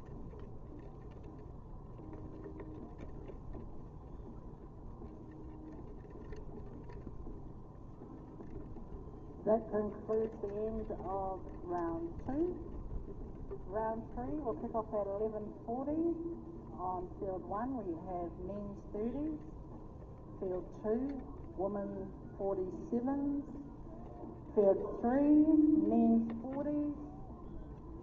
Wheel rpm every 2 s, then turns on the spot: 0, 0, 0, 0, 0, 0, 0, 0, 0, 0, 0, 0, 0, 0.
none